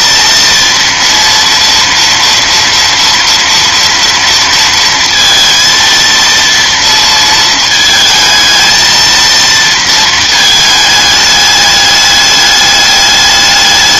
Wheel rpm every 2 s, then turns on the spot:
230, 230, 230, 230, 230, 220, 210.
none